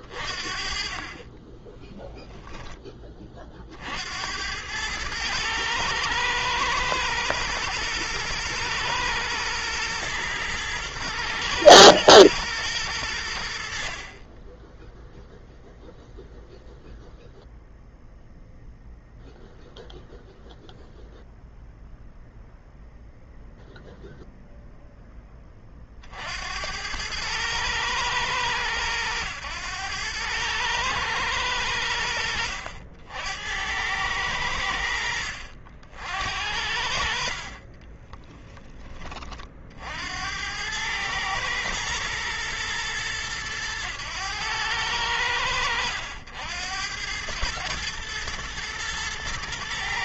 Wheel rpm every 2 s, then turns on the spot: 40, 20, 100, 110, 110, 120, 100, 10, 0, 0, 0, 0, 0, 90, 110, 110, 80, 80, 60, 20, 100, 110, 100, 100, 110.
none